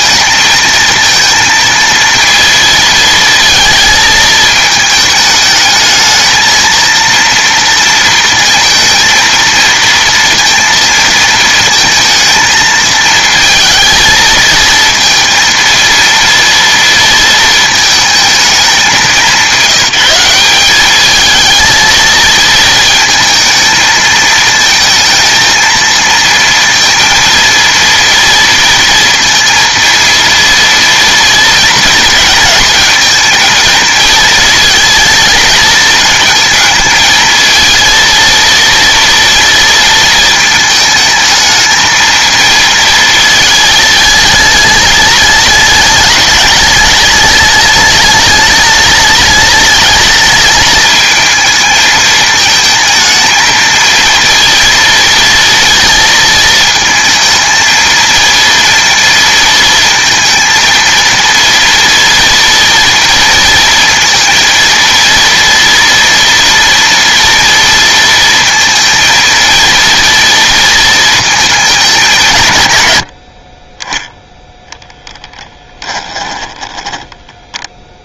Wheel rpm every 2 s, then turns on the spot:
230, 230, 220, 230, 230, 230, 230, 230, 230, 200, 200, 220, 220, 230, 230, 230, 230, 220, 220, 230, 220, 220, 210, 210, 210, 220, 220, 230, 220, 230, 230, 230, 230, 230, 230, 230, 110, 10, 10.
76-78